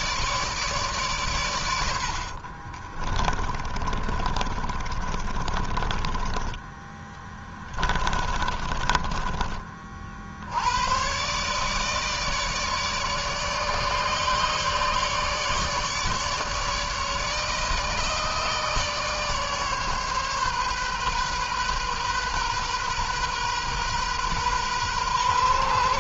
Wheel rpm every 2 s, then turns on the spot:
140, 30, 30, 20, 30, 100, 150, 150, 150, 150, 130, 130, 120.
2-10